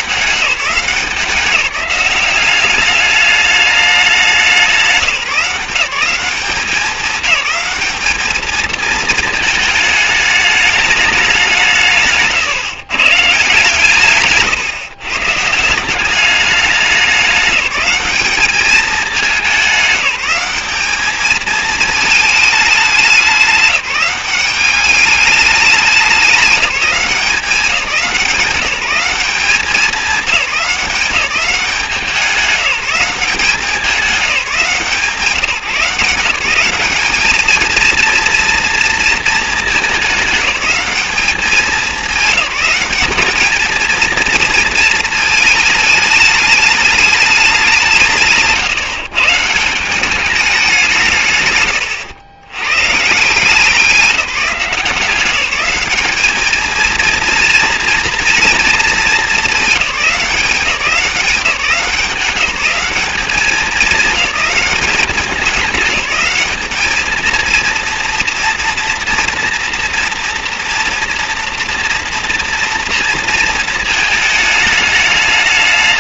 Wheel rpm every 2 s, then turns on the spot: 170, 190, 180, 180, 220, 210, 140, 140, 200, 210, 200, 210, 200, 190, 180, 200, 190, 190, 190, 230, 210, 190, 230, 210, 150, 190, 120, 170, 220, 230, 180, 200, 200, 210, 240, 230, 230, 220.
48-50